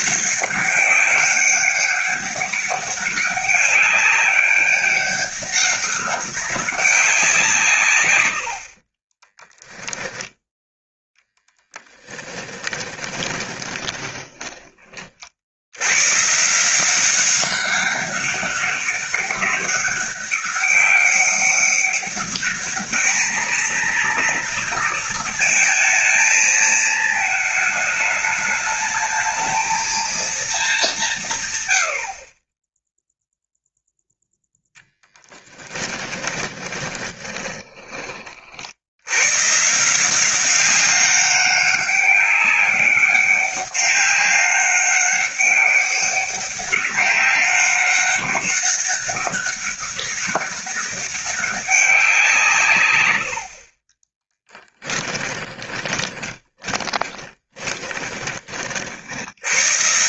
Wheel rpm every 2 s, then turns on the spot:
200, 200, 200, 190, 30, 10, 10, 40, 180, 200, 200, 210, 230, 220, 210, 180, 0, 0, 20, 80, 200, 200, 200, 200, 200, 200, 110, 10, 20, 50.
8-10 12-14 36-38 54-58